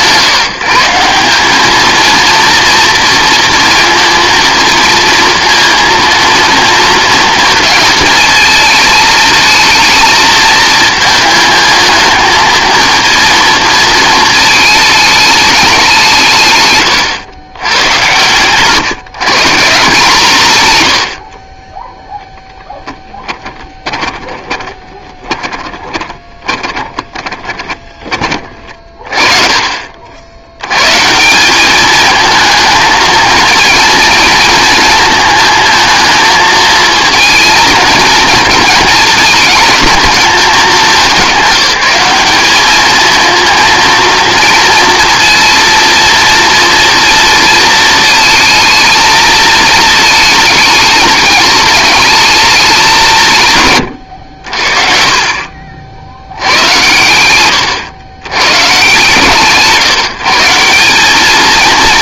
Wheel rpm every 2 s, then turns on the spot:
140, 230, 230, 230, 220, 220, 230, 220, 120, 130, 130, 10, 20, 20, 30, 120, 220, 220, 220, 220, 210, 210, 230, 230, 220, 210, 200, 40, 110, 100, 160.
24-28